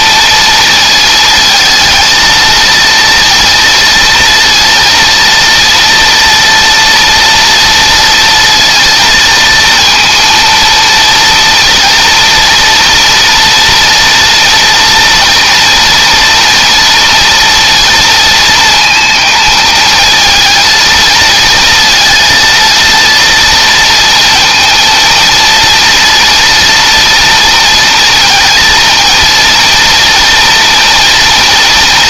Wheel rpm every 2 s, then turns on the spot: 230, 230, 230, 230, 230, 230, 230, 230, 230, 230, 230, 230, 230, 230, 230, 230.
none